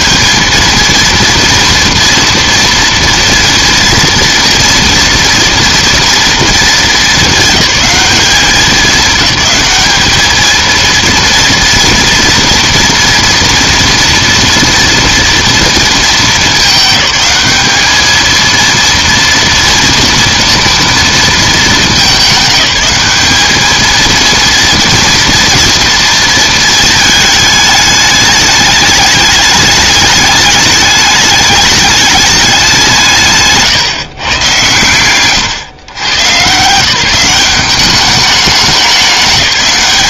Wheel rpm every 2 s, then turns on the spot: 230, 230, 230, 230, 190, 230, 230, 230, 210, 230, 230, 210, 230, 220, 210, 210, 190, 120, 160, 200.
none